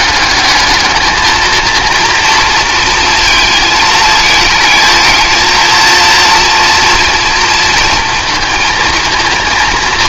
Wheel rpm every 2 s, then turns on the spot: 220, 230, 220, 240, 230.
none